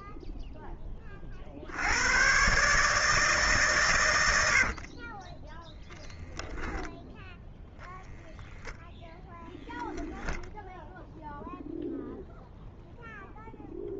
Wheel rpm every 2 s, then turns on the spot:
10, 130, 80, 0, 0, 0, 0.
4-6